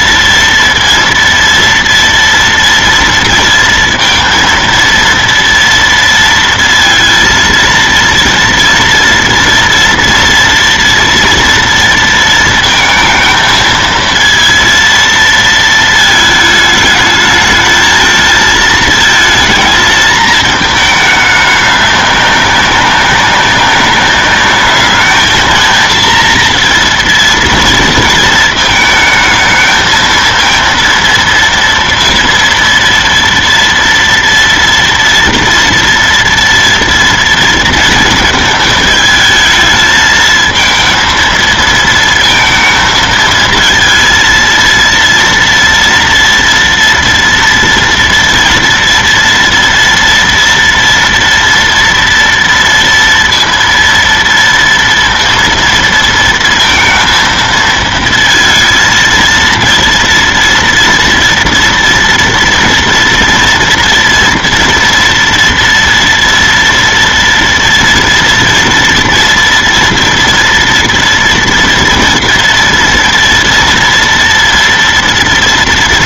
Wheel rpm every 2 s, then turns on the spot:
230, 230, 230, 230, 230, 230, 230, 230, 220, 220, 220, 200, 210, 230, 220, 230, 230, 230, 230, 220, 230, 230, 230, 230, 240, 230, 230, 230, 230, 230, 240, 230, 230, 230, 230, 230, 230, 230.
none